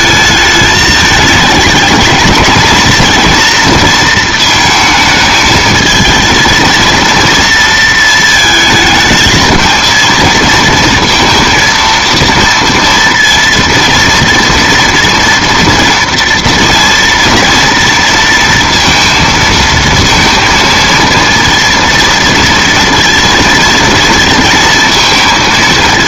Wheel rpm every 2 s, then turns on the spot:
220, 230, 220, 230, 220, 230, 230, 230, 230, 230, 230, 230, 230.
none